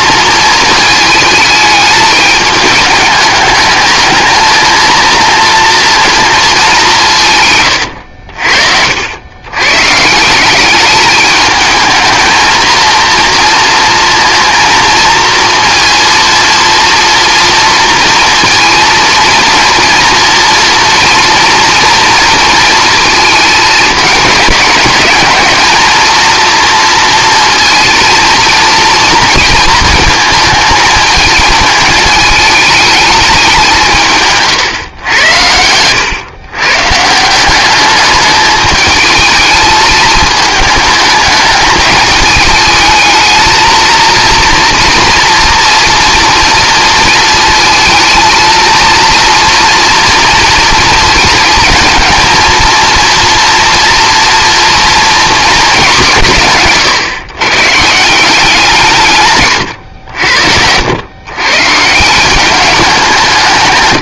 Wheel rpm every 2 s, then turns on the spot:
220, 210, 230, 190, 70, 200, 230, 230, 230, 230, 230, 230, 210, 230, 230, 220, 210, 120, 140, 210, 220, 220, 240, 230, 230, 220, 230, 240, 140, 170, 90, 180.
none